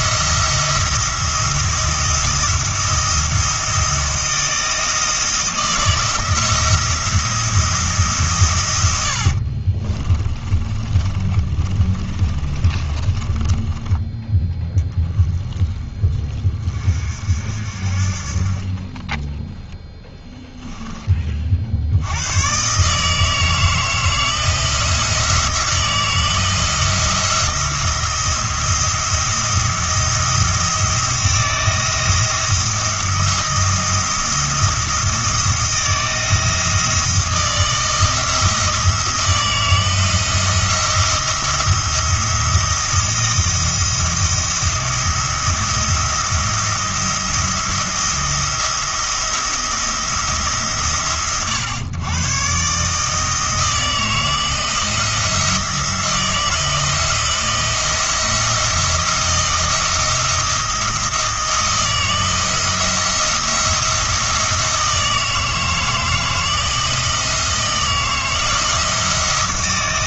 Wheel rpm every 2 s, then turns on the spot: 170, 170, 170, 170, 100, 30, 30, 10, 40, 20, 10, 140, 170, 170, 170, 170, 170, 170, 160, 170, 170, 170, 170, 170, 170, 130, 140, 170, 170, 170, 170, 160, 160, 160, 170.
8-14